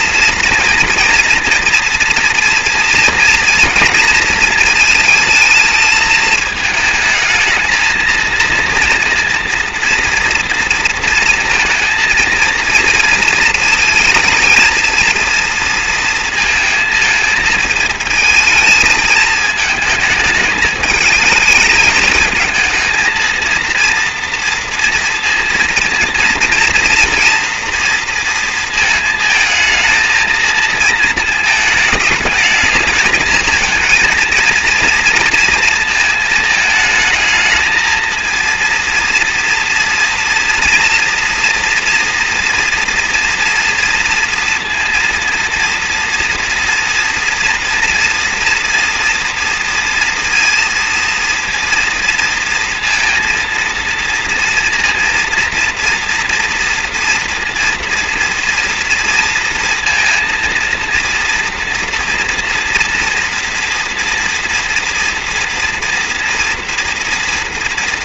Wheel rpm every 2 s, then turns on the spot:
230, 230, 230, 210, 230, 230, 230, 220, 230, 220, 220, 220, 230, 230, 230, 220, 210, 230, 220, 230, 230, 240, 230, 240, 240, 230, 230, 230, 240, 230, 230, 230, 230, 240.
none